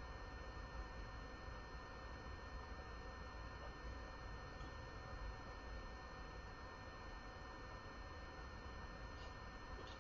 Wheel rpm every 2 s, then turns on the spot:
0, 0, 0, 0, 0.
none